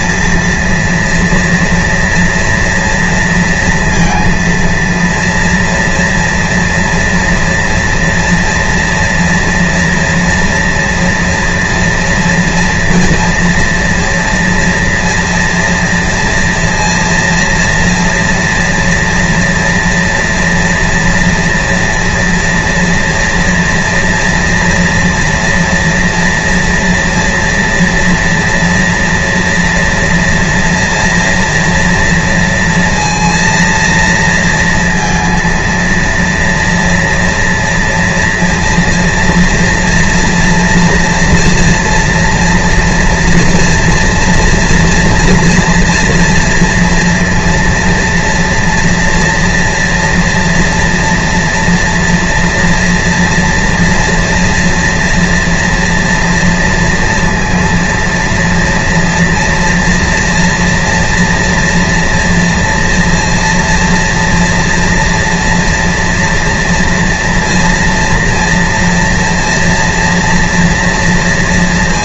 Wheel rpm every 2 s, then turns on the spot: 230, 230, 230, 230, 240, 230, 230, 230, 230, 230, 230, 240, 230, 230, 240, 240, 230, 230, 230, 230, 230, 230, 230, 230, 230, 230, 230, 240, 230, 230, 230, 230, 230, 230, 230, 230.
none